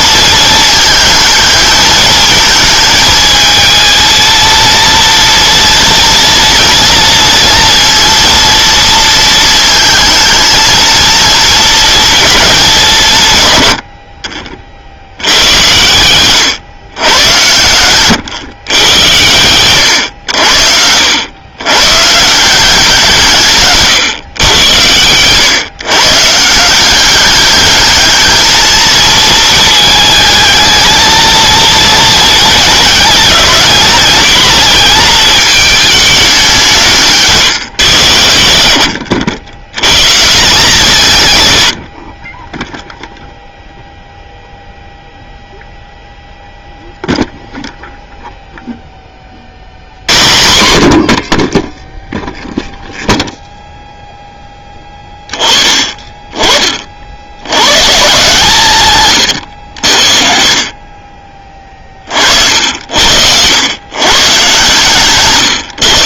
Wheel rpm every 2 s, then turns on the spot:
220, 220, 230, 230, 230, 230, 210, 50, 120, 120, 80, 170, 110, 160, 220, 220, 220, 230, 190, 70, 170, 20, 0, 0, 0, 90, 0, 10, 30, 150, 50, 60, 140.
60-62